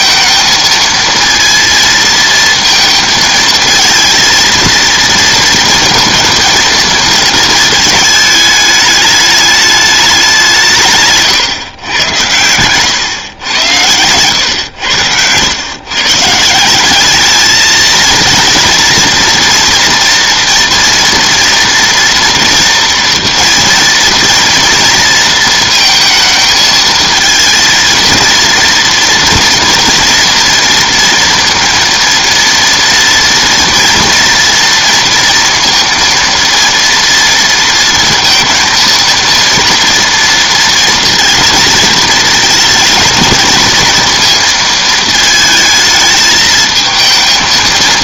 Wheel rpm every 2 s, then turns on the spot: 220, 230, 230, 220, 210, 140, 120, 100, 200, 230, 230, 240, 230, 220, 230, 230, 230, 230, 230, 230, 230, 230, 220, 220.
none